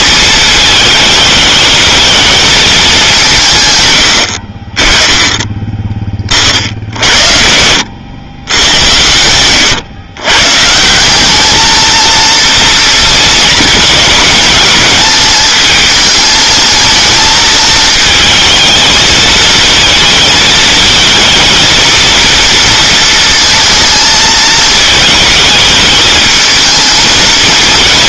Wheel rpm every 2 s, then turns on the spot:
220, 210, 30, 50, 90, 140, 230, 220, 220, 220, 230, 230, 220, 220.
none